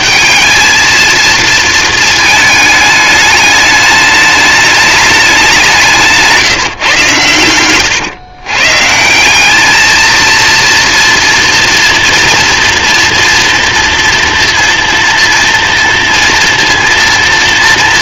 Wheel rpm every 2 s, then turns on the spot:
150, 230, 210, 190, 110, 210, 230, 230, 230.
8-10